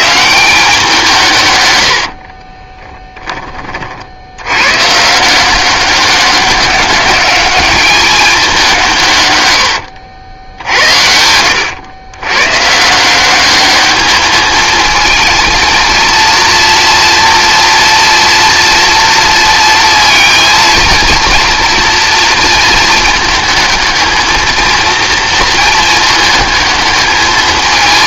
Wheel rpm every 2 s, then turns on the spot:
160, 50, 80, 200, 200, 80, 120, 210, 230, 230, 230, 230, 230, 220.
2-4 10-12